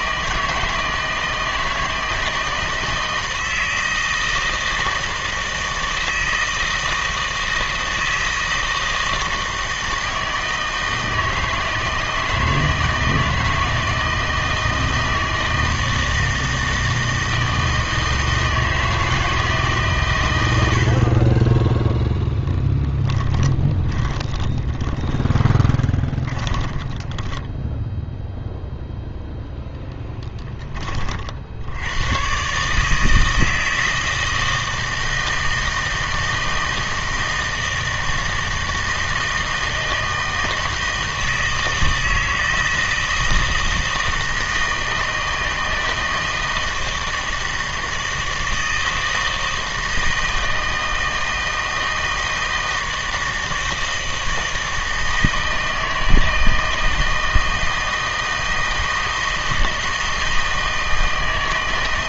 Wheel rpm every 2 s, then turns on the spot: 160, 160, 160, 160, 160, 160, 160, 160, 160, 160, 80, 10, 20, 20, 0, 20, 150, 160, 160, 160, 160, 160, 160, 160, 160, 160, 160, 160, 160, 160, 160.
22-28